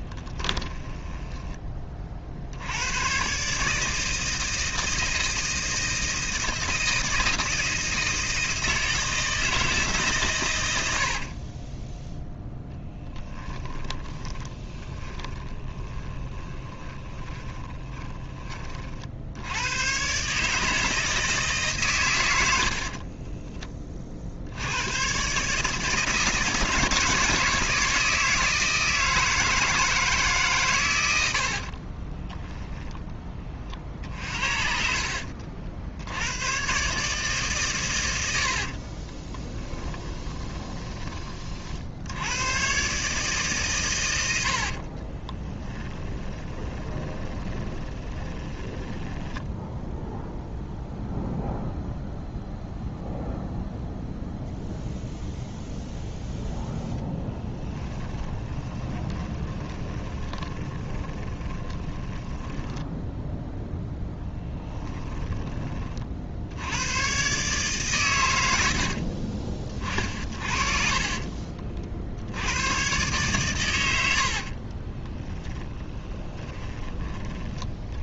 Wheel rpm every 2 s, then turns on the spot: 20, 90, 160, 160, 160, 100, 10, 20, 20, 40, 160, 60, 100, 160, 160, 120, 10, 50, 130, 50, 20, 130, 60, 20, 10, 0, 0, 0, 10, 20, 20, 10, 10, 90, 60, 40, 100, 20, 30.
0-2 12-18 22-24 38-42 44-50 56-66 70-72 74-76